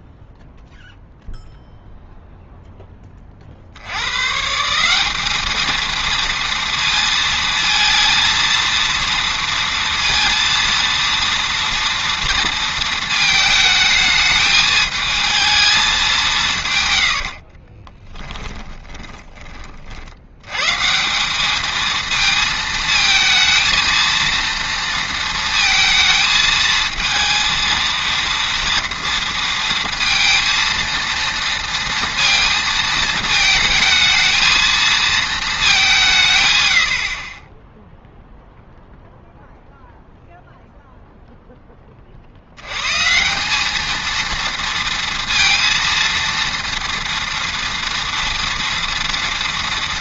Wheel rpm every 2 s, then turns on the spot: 0, 0, 160, 230, 230, 230, 230, 220, 140, 20, 130, 220, 230, 220, 230, 230, 230, 220, 100, 0, 0, 100, 230, 230, 230.
18-20